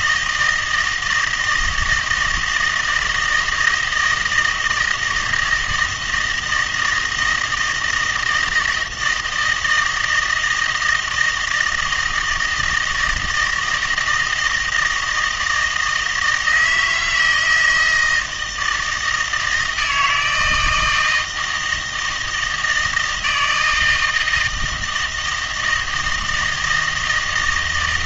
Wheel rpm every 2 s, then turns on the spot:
160, 160, 160, 160, 160, 160, 160, 170, 160, 160, 160, 160, 160, 160.
none